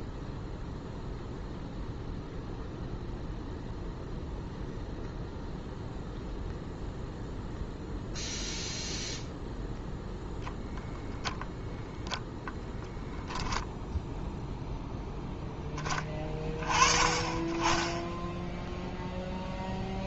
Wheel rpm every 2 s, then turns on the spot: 0, 0, 0, 0, 0, 0, 0, 0, 20, 0.
none